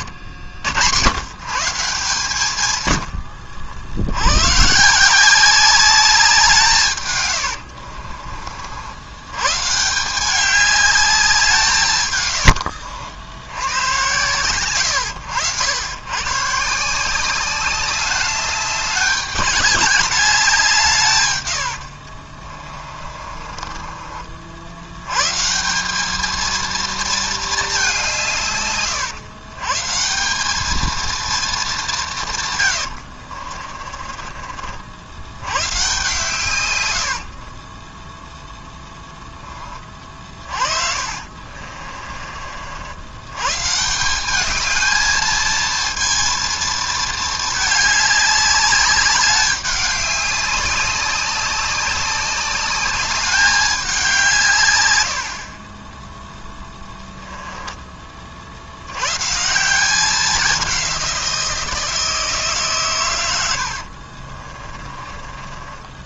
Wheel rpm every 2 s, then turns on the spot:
110, 100, 160, 130, 90, 200, 80, 100, 160, 200, 150, 40, 100, 230, 120, 220, 80, 70, 90, 10, 50, 90, 220, 220, 200, 190, 200, 110, 10, 110, 180, 130, 20.
22-24 32-34 40-42 56-58 64-66